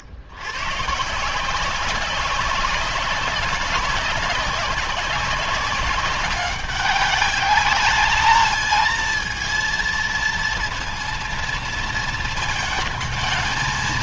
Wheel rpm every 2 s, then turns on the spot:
130, 190, 190, 200, 230, 230, 220.
none